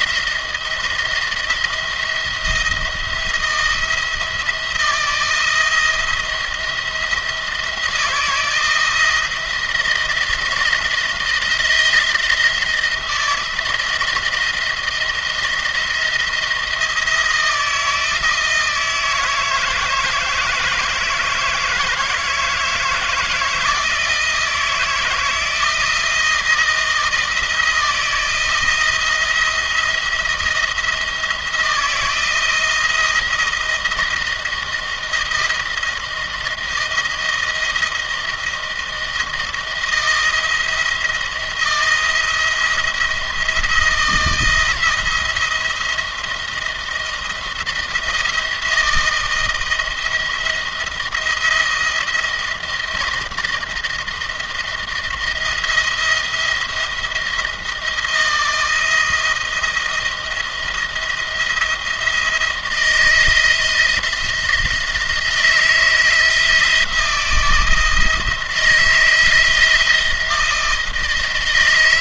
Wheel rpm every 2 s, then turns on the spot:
170, 170, 170, 170, 170, 170, 170, 170, 170, 160, 160, 160, 160, 160, 170, 170, 170, 170, 170, 170, 170, 170, 160, 170, 160, 170, 160, 160, 170, 160, 160, 160, 170, 160, 160, 160.
none